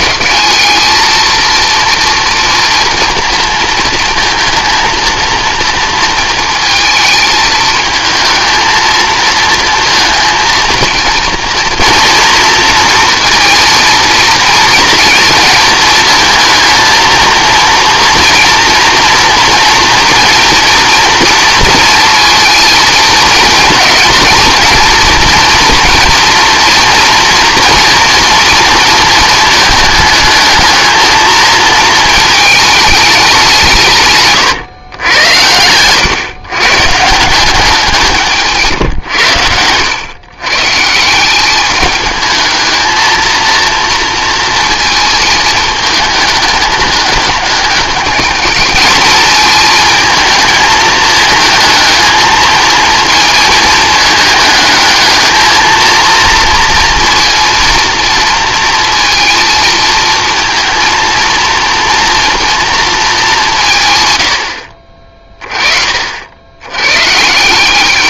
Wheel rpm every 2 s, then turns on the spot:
210, 230, 230, 230, 230, 230, 230, 230, 230, 230, 230, 220, 230, 240, 230, 220, 220, 130, 130, 150, 140, 220, 230, 210, 220, 220, 230, 210, 230, 230, 230, 230, 80, 90.
none